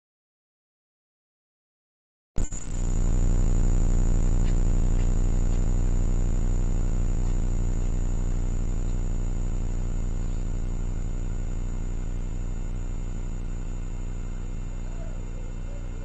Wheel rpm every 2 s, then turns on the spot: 0, 0, 0, 0, 0, 0, 0, 0.
none